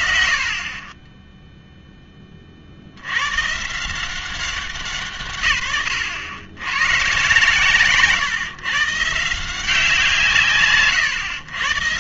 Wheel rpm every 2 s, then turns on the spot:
50, 60, 180, 100, 130, 130.
none